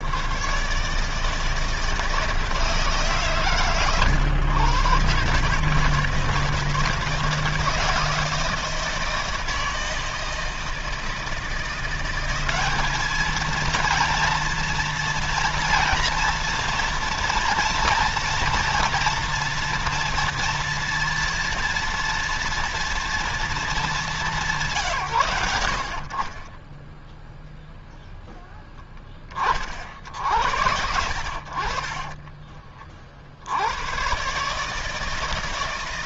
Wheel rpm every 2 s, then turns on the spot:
120, 160, 120, 160, 170, 160, 190, 230, 230, 230, 230, 230, 140, 0, 10, 60, 30, 160.
none